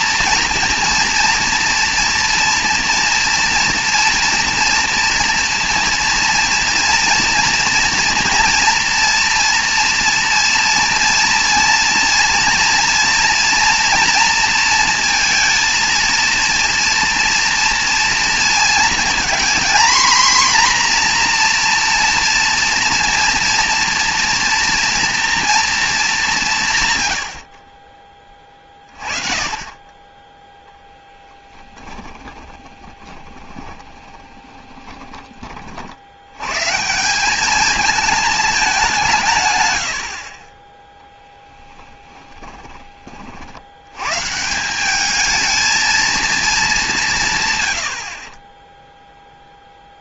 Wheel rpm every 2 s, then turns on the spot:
230, 240, 230, 240, 230, 230, 230, 230, 240, 230, 250, 230, 230, 150, 30, 20, 20, 20, 140, 200, 30, 20, 180, 210, 20.
30-36 42-44